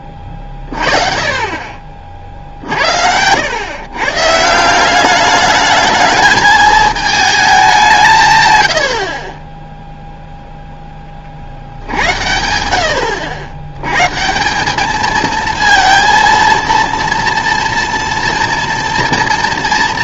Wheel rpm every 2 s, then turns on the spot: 40, 50, 160, 220, 110, 0, 90, 180, 230, 240.
none